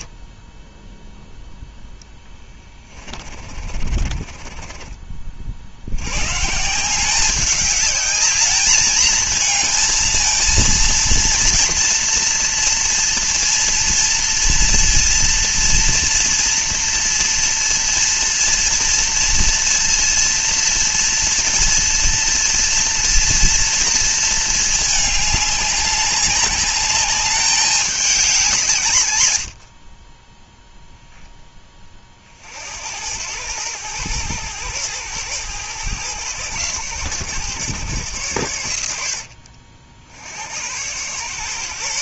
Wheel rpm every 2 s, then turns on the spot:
0, 20, 30, 170, 220, 230, 230, 230, 230, 230, 230, 230, 210, 200, 140, 0, 80, 110, 110, 80, 100.
2-6